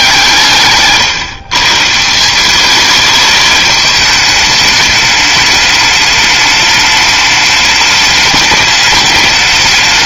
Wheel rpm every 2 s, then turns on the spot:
150, 200, 210, 210, 210.
none